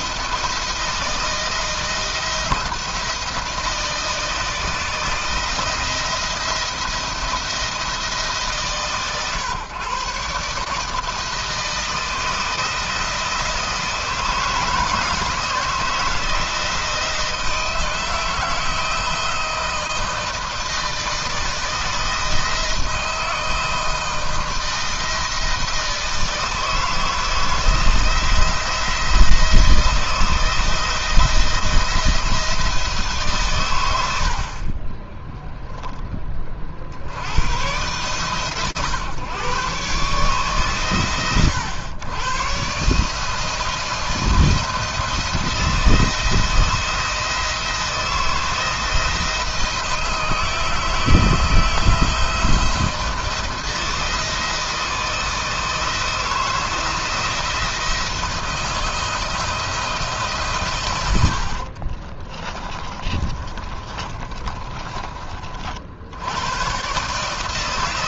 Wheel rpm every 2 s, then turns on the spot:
170, 170, 160, 170, 140, 160, 160, 160, 160, 160, 160, 170, 160, 170, 170, 160, 150, 20, 40, 130, 120, 150, 170, 170, 170, 160, 170, 160, 170, 170, 100, 30, 30, 140.
60-64